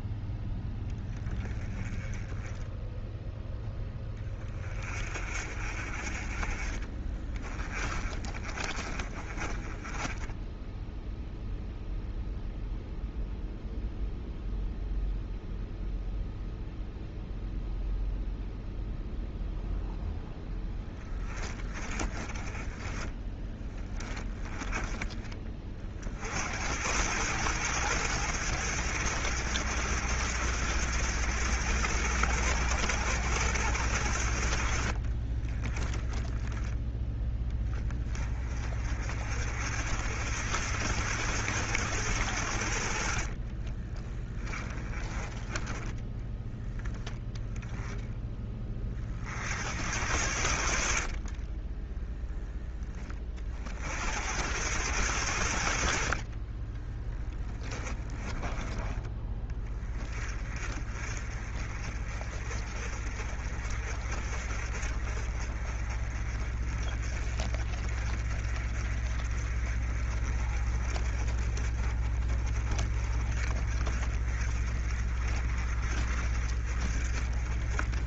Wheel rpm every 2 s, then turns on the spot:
10, 10, 30, 30, 30, 10, 0, 0, 0, 0, 20, 10, 20, 90, 100, 100, 100, 50, 10, 40, 80, 60, 20, 10, 30, 50, 20, 100, 10, 10, 30, 40, 40, 40, 40, 40, 40, 40, 40.
6-10 20-22 34-36 42-44 50-52 56-58